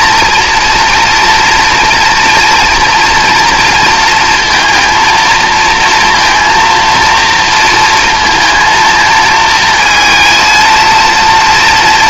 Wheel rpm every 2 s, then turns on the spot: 230, 230, 230, 230, 230, 230.
none